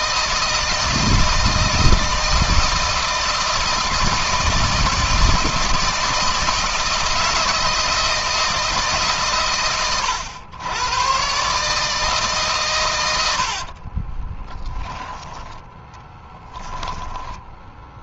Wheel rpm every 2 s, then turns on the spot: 160, 160, 160, 160, 160, 110, 120, 10, 10.
16-18